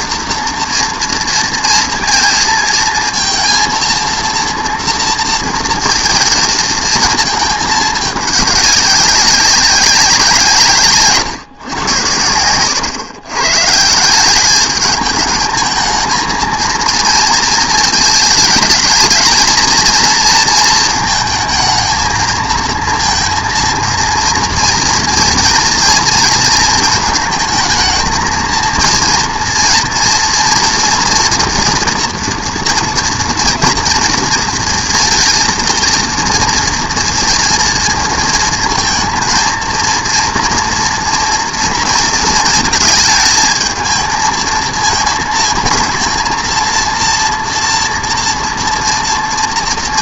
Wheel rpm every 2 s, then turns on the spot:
240, 230, 230, 230, 200, 160, 100, 200, 220, 210, 220, 220, 230, 230, 230, 230, 230, 230, 230, 230, 230, 220, 220, 230, 230.
none